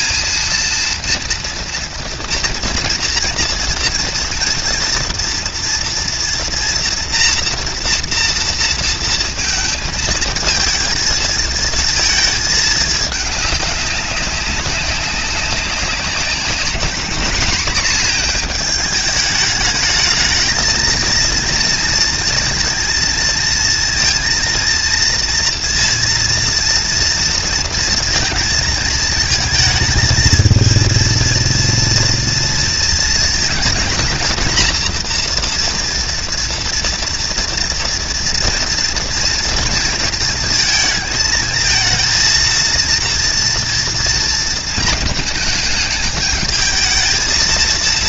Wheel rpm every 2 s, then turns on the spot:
230, 230, 230, 230, 230, 220, 210, 190, 200, 220, 220, 220, 230, 230, 220, 230, 230, 240, 230, 230, 220, 230, 220, 220.
none